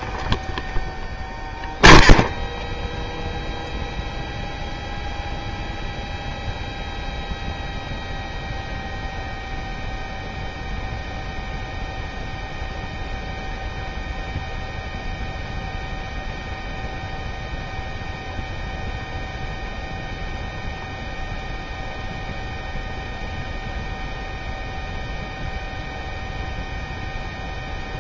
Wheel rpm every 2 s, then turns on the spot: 0, 0, 0, 0, 0, 0, 0, 0, 0, 0, 0, 0, 0, 0.
none